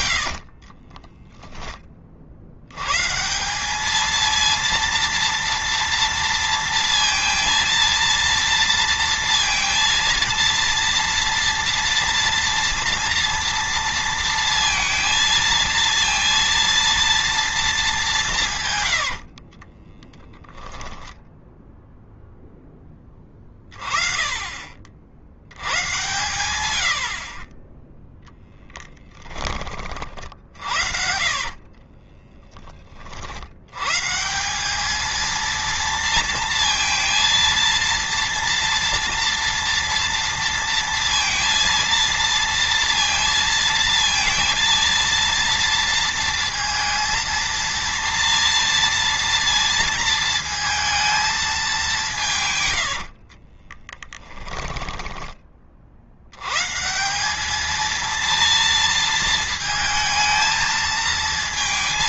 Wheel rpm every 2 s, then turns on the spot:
30, 110, 230, 230, 230, 230, 230, 230, 230, 110, 10, 10, 40, 80, 10, 50, 20, 200, 230, 230, 230, 230, 230, 230, 230, 230, 100, 10, 140, 230, 220.
0-2 18-22 30-32 52-56